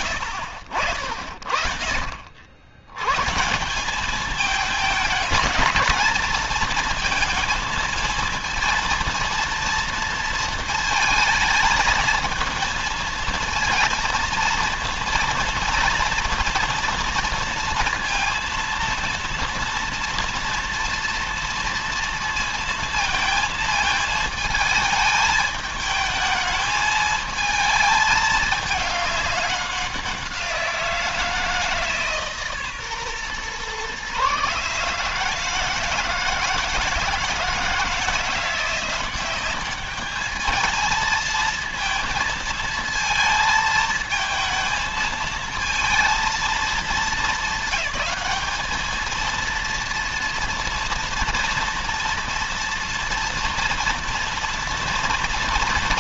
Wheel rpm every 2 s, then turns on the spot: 50, 110, 210, 220, 230, 220, 220, 230, 230, 230, 230, 230, 220, 220, 210, 170, 140, 150, 160, 180, 220, 220, 220, 210, 220, 230, 230, 230.
none